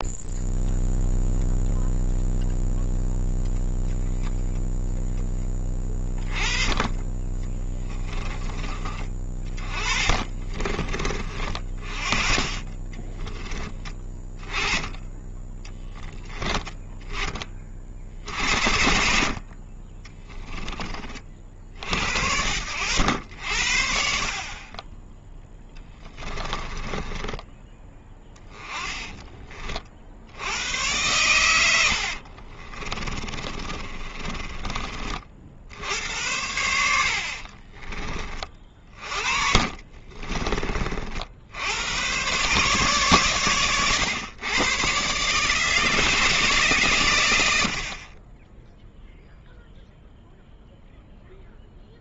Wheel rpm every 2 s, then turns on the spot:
0, 0, 0, 20, 30, 30, 20, 20, 10, 70, 30, 80, 20, 20, 20, 110, 30, 30, 70, 30, 40, 130, 130, 130, 0, 0.
26-30 32-34 38-40